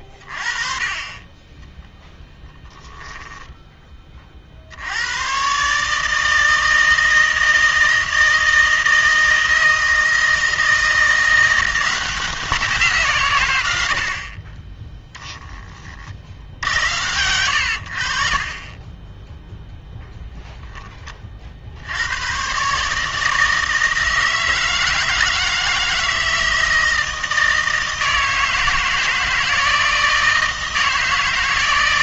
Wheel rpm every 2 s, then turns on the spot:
30, 10, 60, 160, 160, 160, 170, 20, 70, 20, 10, 140, 160, 160, 160, 160.
none